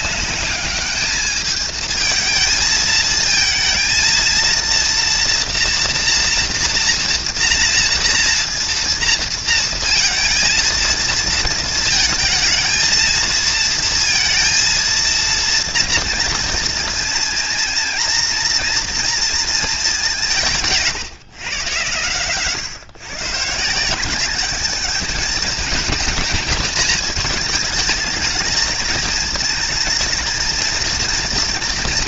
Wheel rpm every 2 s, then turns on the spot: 200, 220, 230, 240, 230, 230, 230, 230, 230, 230, 160, 130, 200, 220, 220, 230.
none